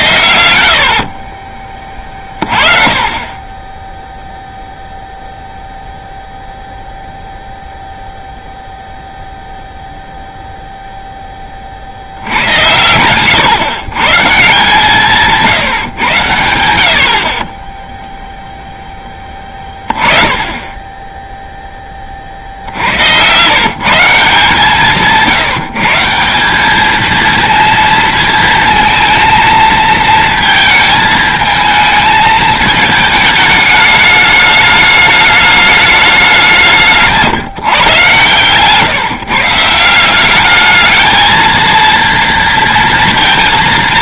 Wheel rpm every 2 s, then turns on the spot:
80, 40, 0, 0, 0, 0, 80, 150, 90, 0, 20, 60, 160, 190, 230, 220, 220, 210, 190, 130, 210, 230.
12-14 38-40